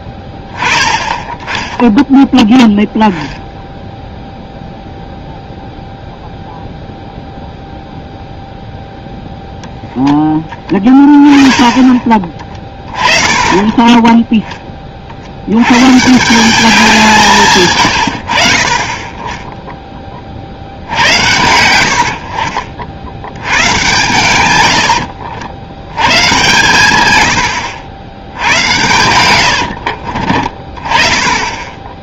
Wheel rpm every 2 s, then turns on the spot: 10, 0, 0, 0, 0, 10, 30, 20, 190, 40, 70, 60, 90, 120, 90, 30.
12-14 24-26